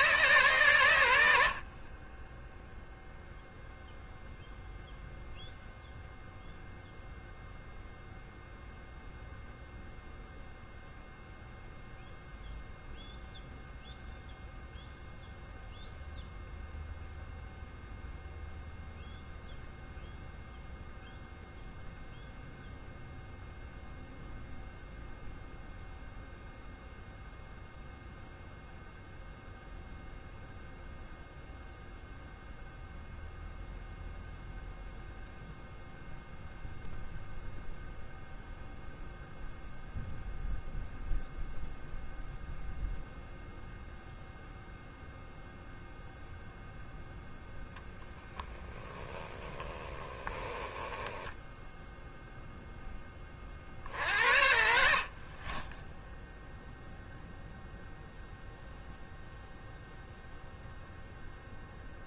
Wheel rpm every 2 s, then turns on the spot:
100, 0, 0, 0, 0, 0, 0, 0, 0, 0, 0, 0, 0, 0, 0, 0, 0, 0, 0, 0, 0, 0, 0, 0, 20, 20, 10, 60, 0, 0, 0.
48-52